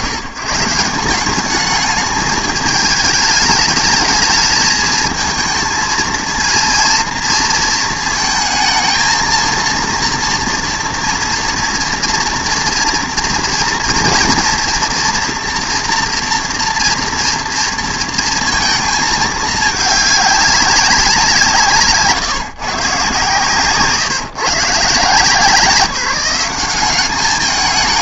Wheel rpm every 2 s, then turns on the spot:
120, 210, 220, 230, 230, 240, 230, 230, 240, 220, 200, 150, 140, 190.
none